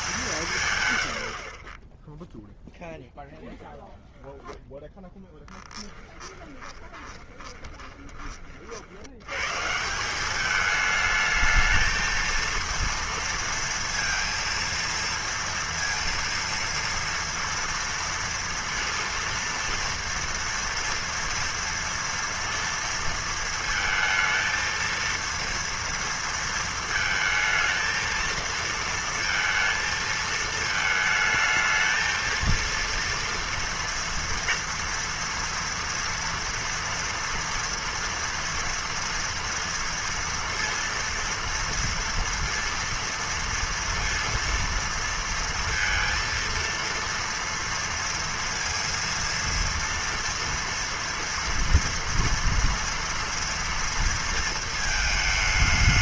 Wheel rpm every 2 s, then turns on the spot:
100, 0, 0, 20, 70, 210, 230, 230, 230, 230, 230, 230, 230, 220, 230, 220, 230, 230, 230, 230, 230, 230, 230, 230, 230, 230, 230, 220.
6-8